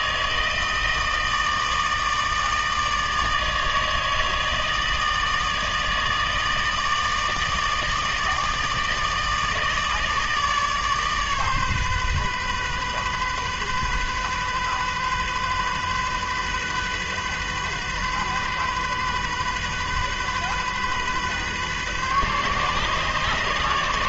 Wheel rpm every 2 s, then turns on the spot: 160, 160, 160, 160, 160, 150, 130, 130, 130, 130, 130, 140.
none